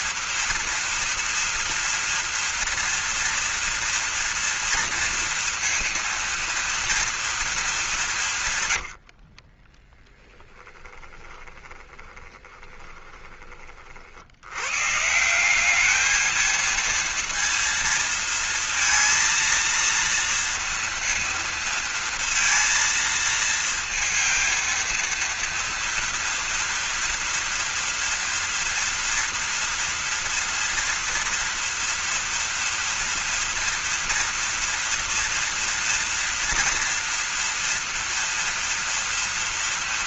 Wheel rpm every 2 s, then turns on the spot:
230, 230, 230, 230, 90, 20, 20, 140, 220, 230, 230, 230, 230, 230, 230, 230, 240, 230, 240, 230.
8-14